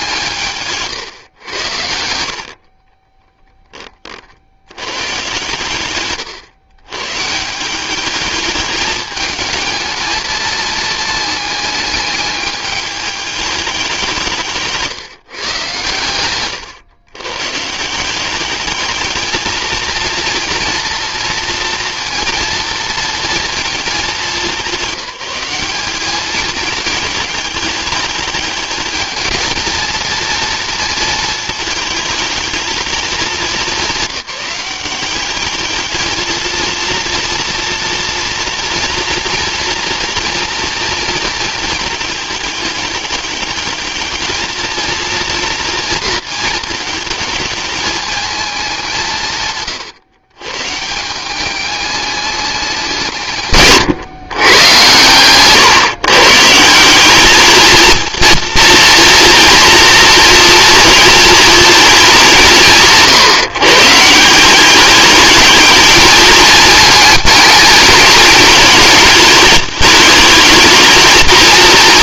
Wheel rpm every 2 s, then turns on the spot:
140, 40, 110, 130, 220, 220, 210, 170, 110, 210, 230, 230, 200, 220, 220, 230, 210, 200, 230, 230, 230, 210, 230, 220, 190, 150, 180, 110, 190, 240, 230, 150, 210, 220, 220, 220.
0-4